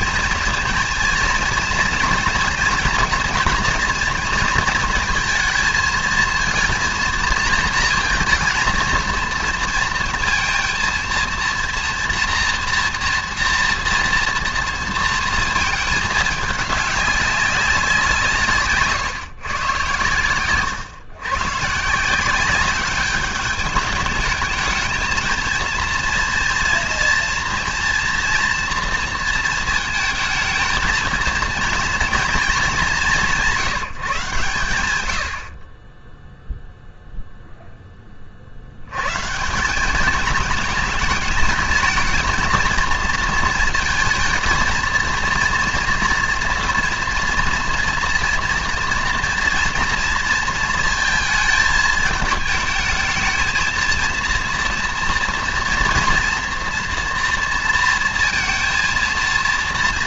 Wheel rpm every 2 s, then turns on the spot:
230, 230, 230, 230, 230, 230, 240, 230, 210, 140, 130, 200, 210, 230, 240, 220, 210, 120, 0, 70, 220, 230, 230, 240, 230, 230, 220, 230, 230, 230.
none